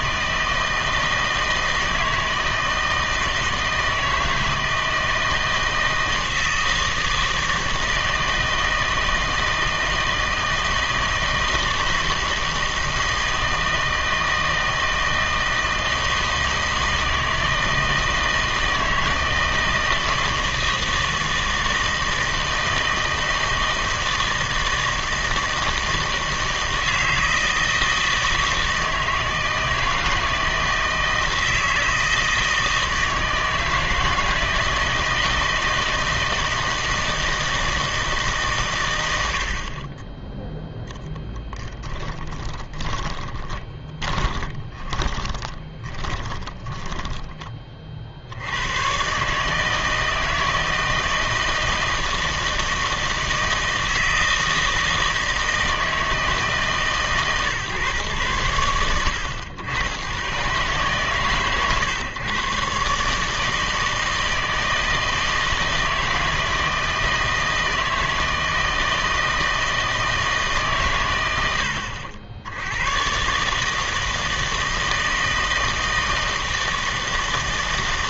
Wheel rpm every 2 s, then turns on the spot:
160, 160, 160, 160, 160, 160, 160, 160, 160, 160, 160, 160, 160, 160, 160, 160, 160, 160, 160, 120, 0, 20, 20, 20, 110, 160, 160, 160, 140, 90, 140, 140, 160, 160, 160, 140, 100, 160, 160.
42-48